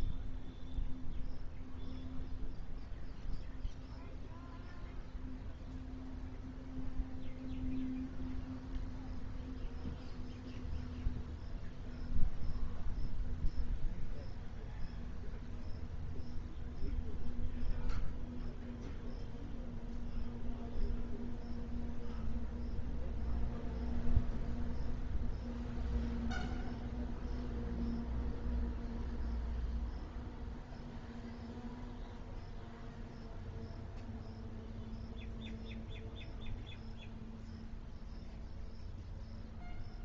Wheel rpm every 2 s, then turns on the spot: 0, 0, 0, 0, 0, 0, 0, 0, 0, 0, 0, 0, 0, 0, 0, 0, 0, 0, 0, 0.
none